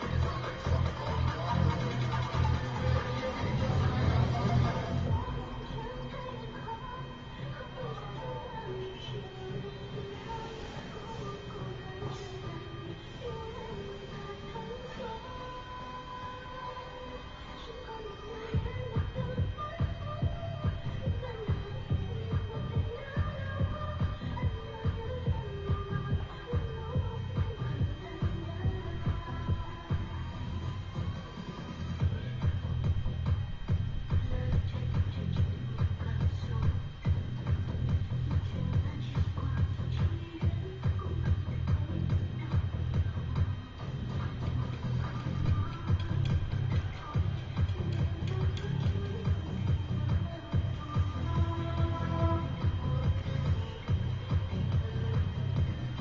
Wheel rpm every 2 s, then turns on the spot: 0, 0, 0, 0, 0, 0, 0, 0, 0, 0, 0, 0, 0, 0, 0, 0, 0, 0, 0, 0, 0, 0, 0, 0, 0, 0, 0, 0.
none